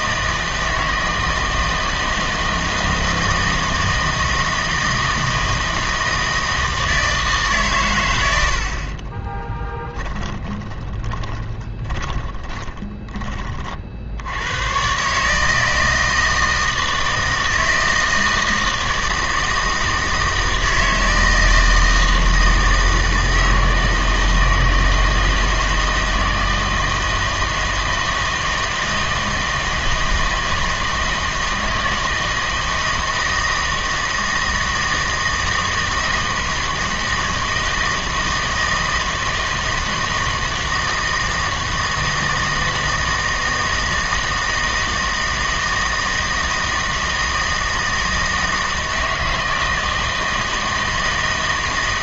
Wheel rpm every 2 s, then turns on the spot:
160, 160, 160, 160, 70, 10, 20, 110, 160, 160, 160, 160, 160, 160, 160, 160, 160, 160, 160, 160, 160, 160, 160, 160, 160, 160.
10-14